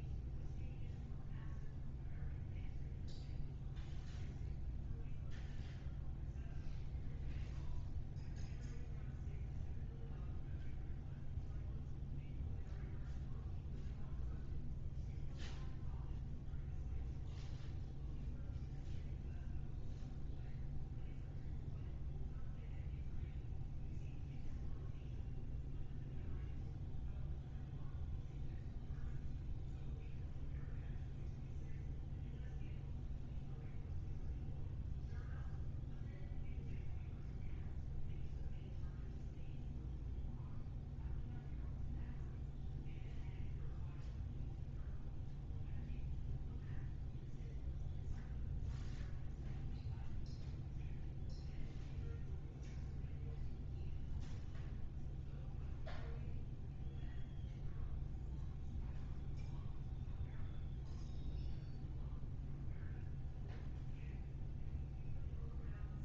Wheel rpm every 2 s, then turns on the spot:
0, 0, 0, 0, 0, 0, 0, 0, 0, 0, 0, 0, 0, 0, 0, 0, 0, 0, 0, 0, 0, 0, 0, 0, 0, 0, 0, 0, 0, 0, 0, 0, 0.
none